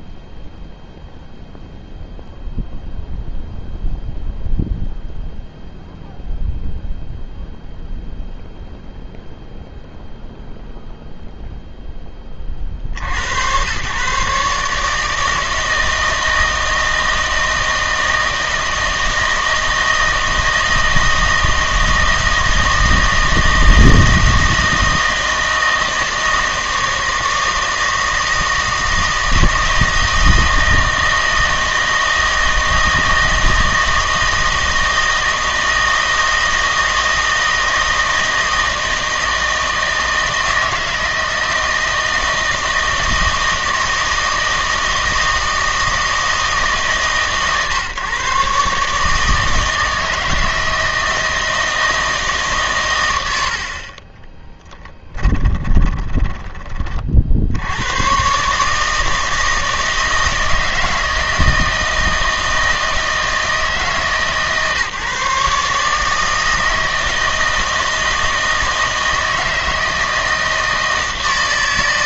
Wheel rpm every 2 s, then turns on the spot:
0, 0, 0, 0, 0, 0, 40, 150, 160, 160, 160, 160, 160, 160, 160, 160, 160, 160, 160, 160, 160, 160, 160, 150, 140, 160, 120, 20, 20, 150, 160, 160, 150, 160, 160, 160.
54-56